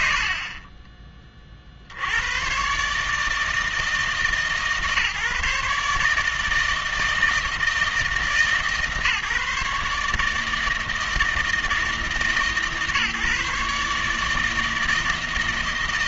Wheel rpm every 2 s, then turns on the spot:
40, 130, 150, 160, 140, 160, 150, 160.
none